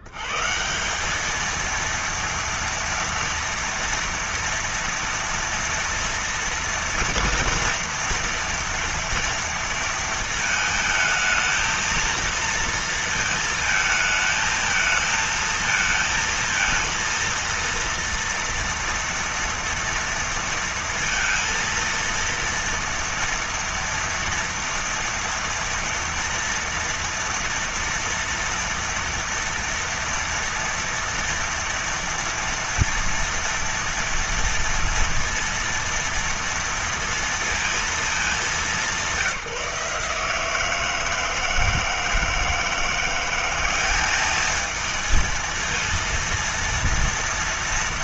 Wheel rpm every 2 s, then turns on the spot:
80, 230, 230, 230, 230, 220, 230, 220, 230, 230, 230, 230, 230, 230, 230, 230, 230, 230, 230, 210, 160, 160, 210, 230.
none